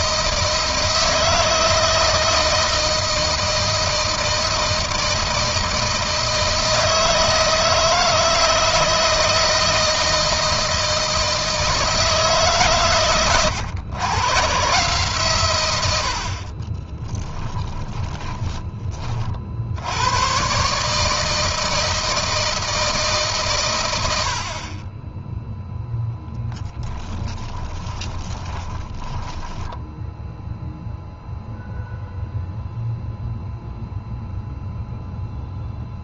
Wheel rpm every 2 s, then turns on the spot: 160, 160, 160, 160, 160, 160, 140, 130, 30, 40, 150, 160, 20, 10, 10, 0, 0, 0.
16-18 26-30